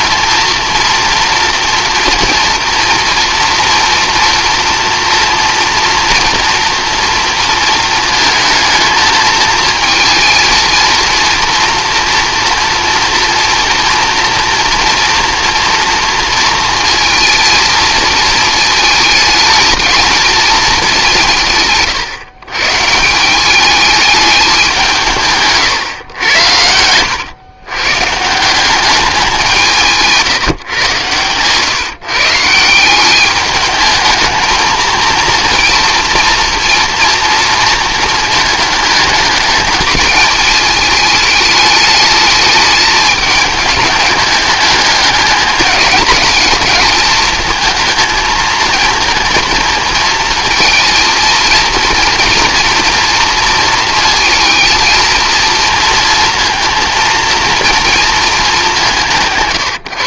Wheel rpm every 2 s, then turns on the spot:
230, 240, 230, 230, 220, 230, 230, 240, 220, 220, 210, 150, 190, 100, 190, 130, 170, 230, 230, 210, 220, 210, 210, 220, 220, 230, 230, 230, 230, 200.
26-28